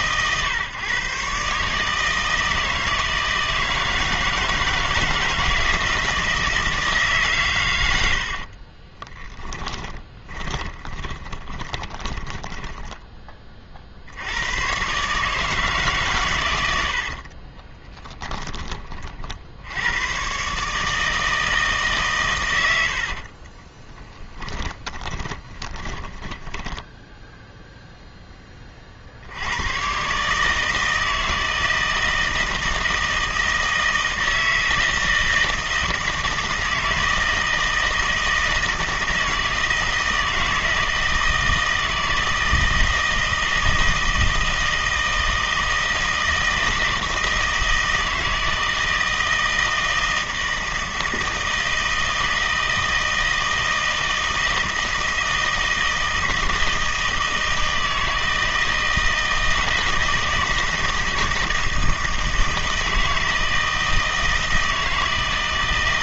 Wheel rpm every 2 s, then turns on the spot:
130, 160, 160, 160, 30, 20, 10, 110, 90, 30, 150, 80, 20, 10, 40, 160, 160, 160, 160, 160, 160, 160, 160, 160, 160, 160, 160, 160, 160, 160, 160, 160, 160.
8-14 24-28